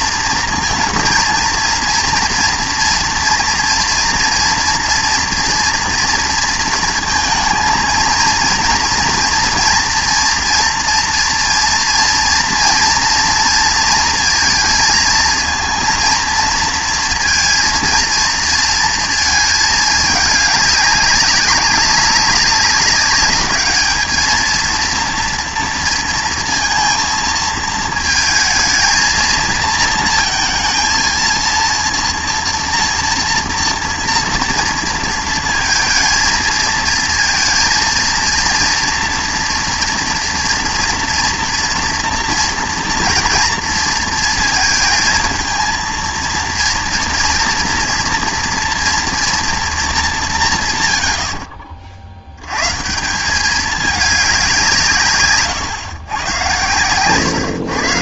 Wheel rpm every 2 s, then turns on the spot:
230, 230, 240, 230, 230, 230, 230, 220, 230, 230, 200, 200, 230, 230, 220, 230, 230, 230, 230, 230, 230, 230, 220, 230, 240, 120, 120, 160, 110.
none